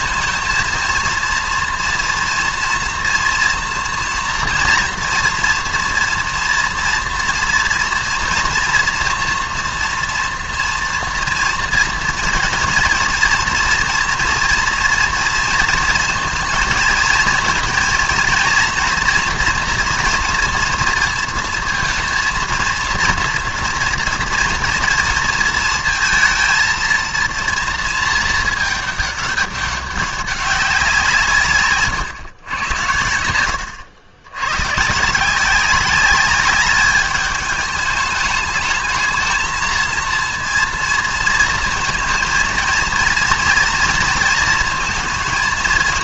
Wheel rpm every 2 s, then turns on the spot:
230, 230, 230, 230, 230, 230, 230, 230, 230, 240, 230, 230, 230, 230, 220, 190, 100, 110, 210, 210, 230, 230, 230.
none